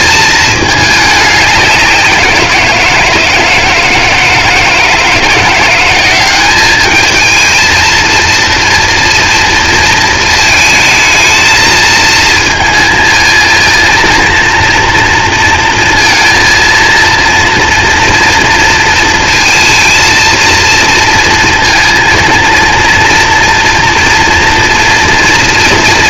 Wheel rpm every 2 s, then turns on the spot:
210, 170, 160, 210, 230, 220, 220, 240, 230, 230, 230, 230, 230.
none